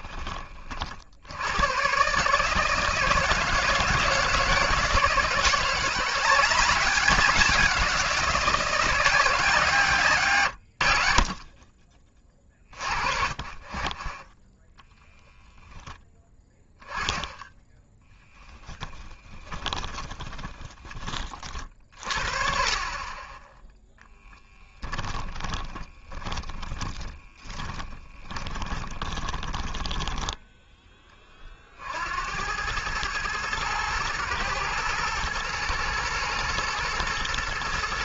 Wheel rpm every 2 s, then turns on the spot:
40, 160, 160, 190, 180, 100, 30, 20, 10, 10, 10, 30, 10, 30, 20, 10, 110, 110, 120.
14-16 18-20 24-30